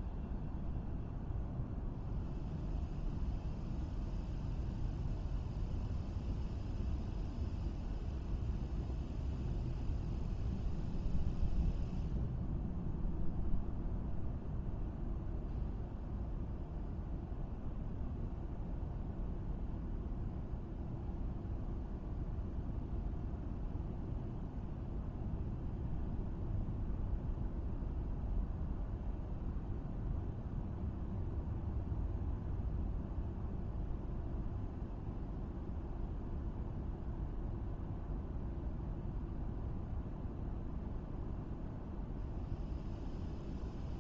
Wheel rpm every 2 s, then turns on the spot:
0, 0, 0, 0, 0, 0, 0, 0, 0, 0, 0, 0, 0, 0, 0, 0, 0, 0, 0, 0, 0, 0.
none